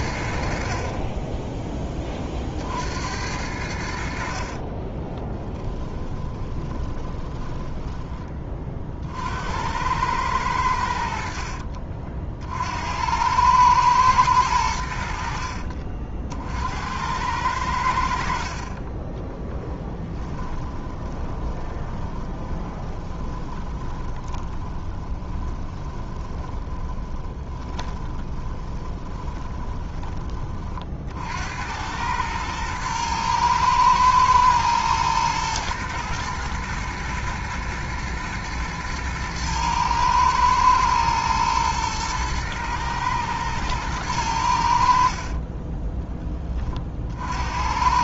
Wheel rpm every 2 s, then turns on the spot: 20, 80, 40, 20, 60, 70, 90, 60, 90, 20, 10, 20, 10, 20, 20, 50, 110, 110, 110, 110, 120, 110, 70, 40.
4-8 18-30